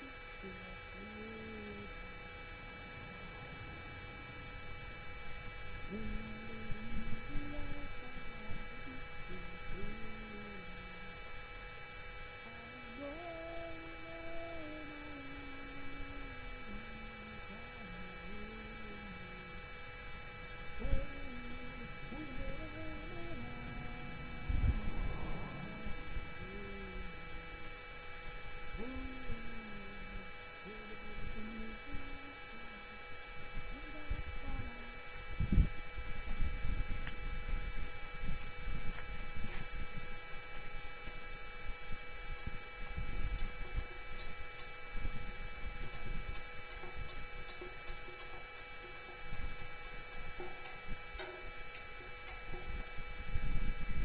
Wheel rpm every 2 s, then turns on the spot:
0, 0, 0, 0, 0, 0, 0, 0, 0, 0, 0, 0, 0, 0, 0, 0, 0, 0, 0, 0, 0, 0, 0, 0, 0, 0, 0.
none